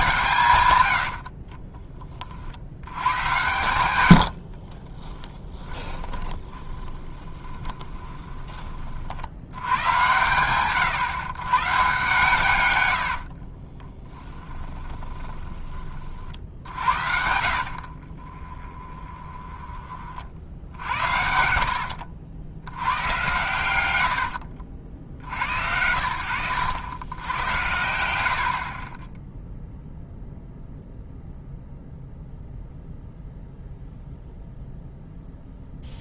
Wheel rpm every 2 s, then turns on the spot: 120, 80, 50, 20, 30, 130, 100, 20, 70, 20, 60, 90, 80, 100, 40, 0, 0, 0.
0-8 12-22 28-30